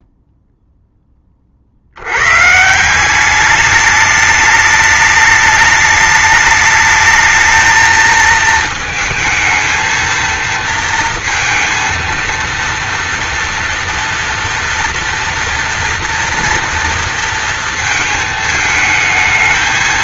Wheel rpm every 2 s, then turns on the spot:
10, 180, 210, 220, 220, 230, 230, 230, 230, 220.
none